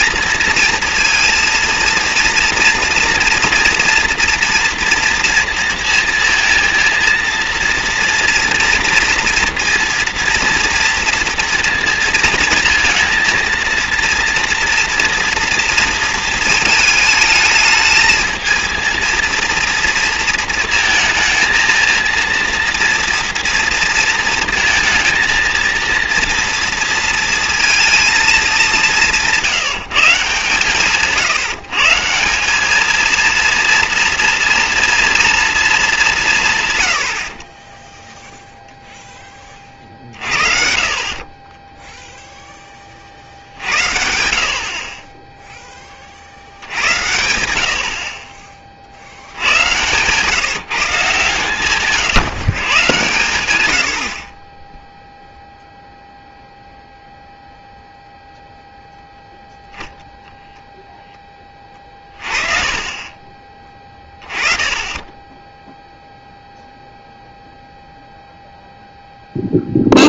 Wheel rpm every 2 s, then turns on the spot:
230, 230, 230, 230, 230, 230, 230, 240, 220, 220, 230, 240, 220, 230, 190, 140, 200, 230, 130, 0, 50, 20, 60, 60, 40, 150, 140, 20, 0, 0, 0, 30, 20, 0, 0.
62-64